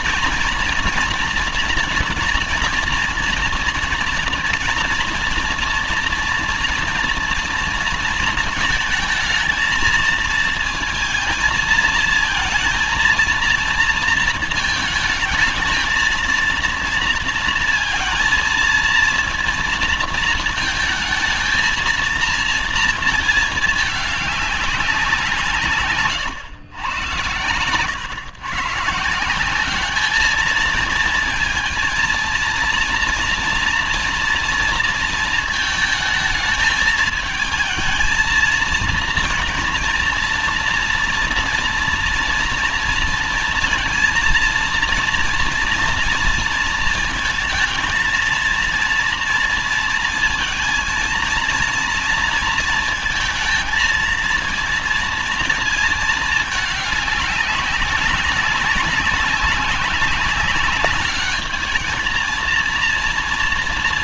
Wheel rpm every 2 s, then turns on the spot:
240, 240, 240, 230, 230, 220, 230, 220, 230, 230, 220, 230, 200, 120, 130, 220, 230, 230, 220, 230, 230, 230, 230, 230, 230, 230, 230, 230, 210, 190, 200, 220.
none